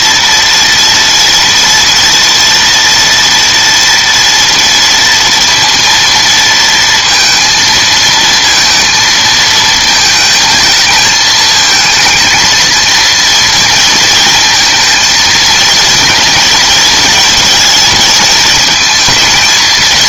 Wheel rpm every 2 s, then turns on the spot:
240, 230, 230, 230, 220, 220, 220, 230, 220, 220.
none